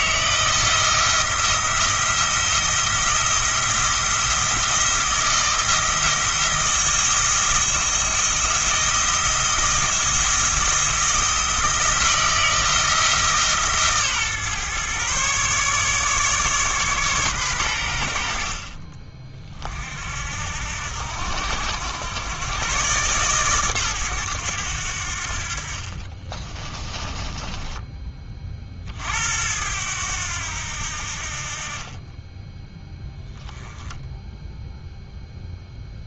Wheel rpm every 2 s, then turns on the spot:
160, 170, 170, 170, 170, 170, 160, 130, 140, 40, 70, 120, 90, 20, 50, 70, 10, 0.
26-28